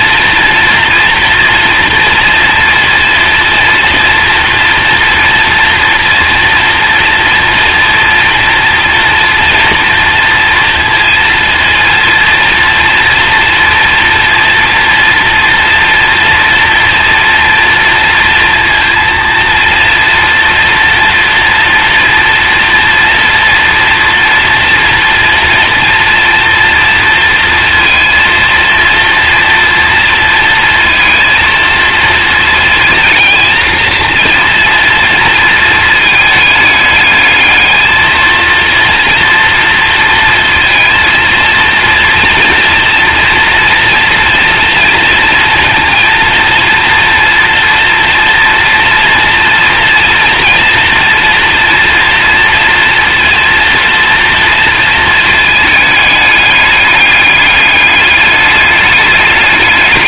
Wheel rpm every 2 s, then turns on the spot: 240, 230, 230, 230, 230, 230, 230, 230, 230, 230, 240, 230, 230, 230, 230, 230, 230, 240, 210, 230, 230, 230, 230, 230, 230, 230, 230, 230, 210, 210.
none